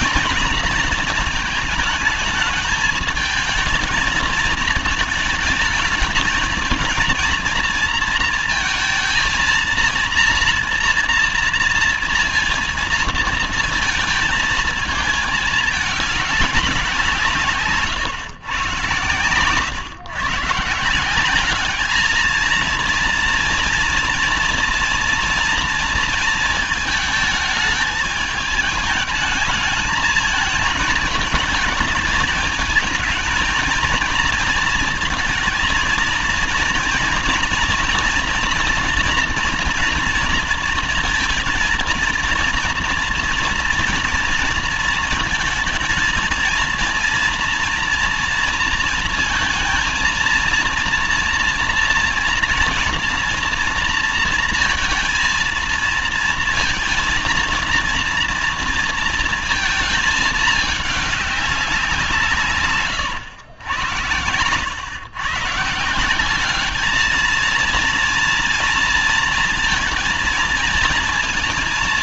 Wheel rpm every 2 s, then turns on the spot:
230, 220, 220, 220, 230, 230, 230, 220, 190, 110, 140, 220, 230, 220, 210, 220, 220, 230, 230, 230, 230, 230, 230, 230, 230, 230, 230, 230, 230, 230, 210, 140, 100, 200, 230, 230.
none